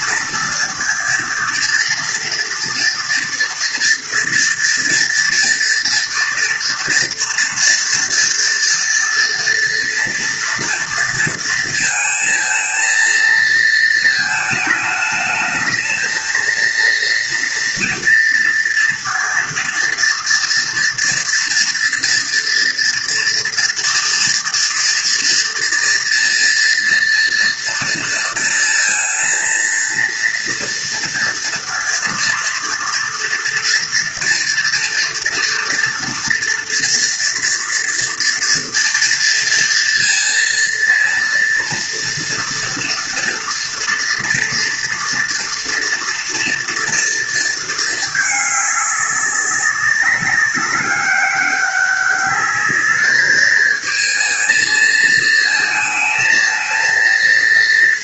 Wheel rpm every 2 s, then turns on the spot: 230, 230, 230, 240, 230, 230, 230, 220, 230, 230, 230, 230, 230, 230, 230, 230, 230, 230, 230, 230, 230, 230, 230, 230, 200, 200, 210, 220, 230.
none